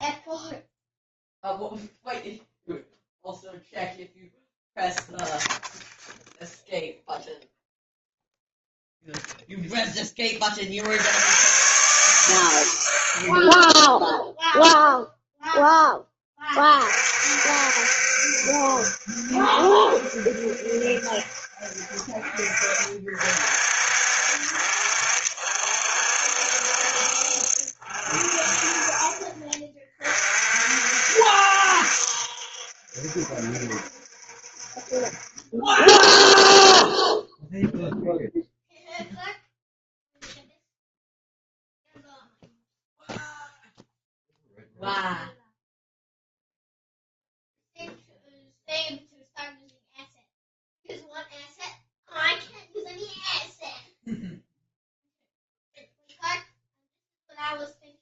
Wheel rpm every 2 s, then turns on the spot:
0, 0, 0, 0, 0, 60, 70, 0, 40, 70, 60, 50, 50, 60, 50, 50, 60, 50, 0, 0, 0, 0, 0, 0, 0, 0, 0, 0, 0.
none